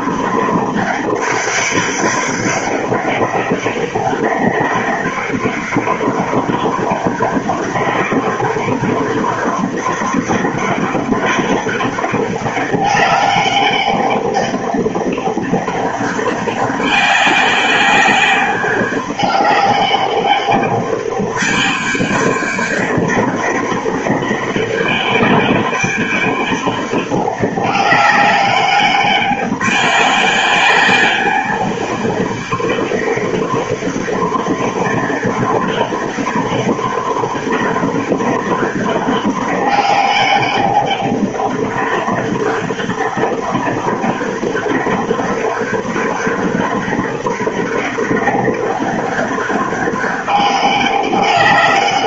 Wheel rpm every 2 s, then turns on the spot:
200, 200, 200, 200, 200, 210, 200, 200, 200, 200, 200, 200, 200, 200, 200, 200, 200, 200, 200, 210, 200, 200, 200, 200, 200, 200.
none